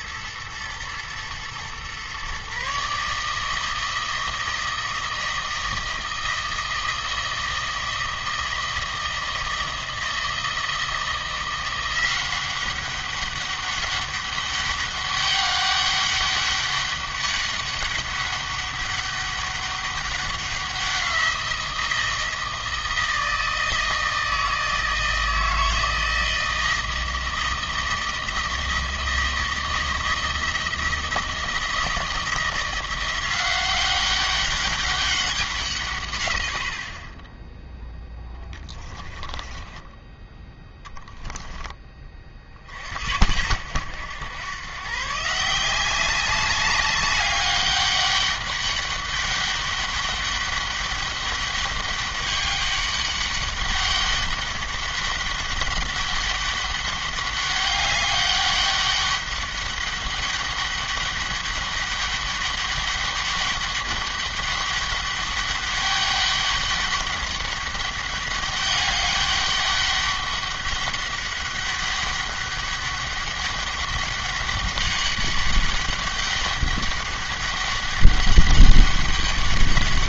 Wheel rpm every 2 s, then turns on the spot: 130, 160, 160, 160, 160, 180, 200, 200, 200, 200, 170, 160, 160, 160, 160, 170, 180, 190, 30, 20, 10, 60, 130, 200, 200, 200, 200, 200, 200, 200, 200, 200, 200, 200, 200, 200, 200, 200, 200, 200.
36-40